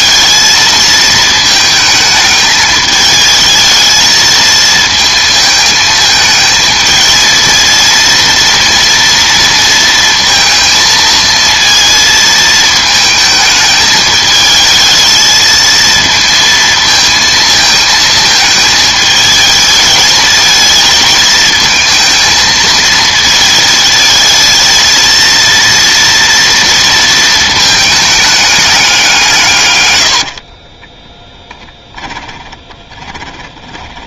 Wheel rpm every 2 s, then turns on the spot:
220, 210, 220, 220, 230, 230, 220, 220, 230, 220, 220, 220, 230, 230, 200, 30, 20.
30-34